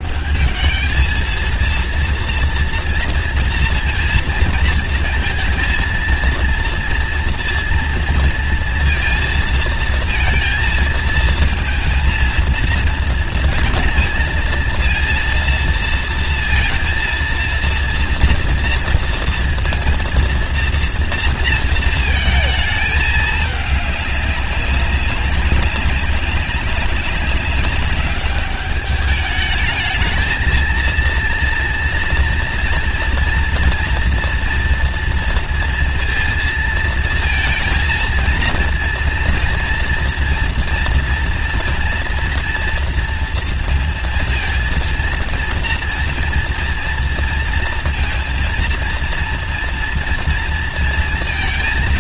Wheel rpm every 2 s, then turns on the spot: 190, 230, 230, 230, 230, 230, 230, 230, 230, 230, 230, 220, 190, 190, 200, 220, 230, 230, 230, 230, 240, 230, 230, 230, 230, 230.
none